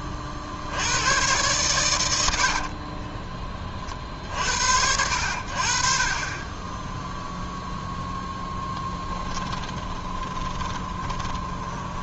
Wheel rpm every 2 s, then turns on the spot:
60, 70, 70, 30, 10, 20.
2-4 10-12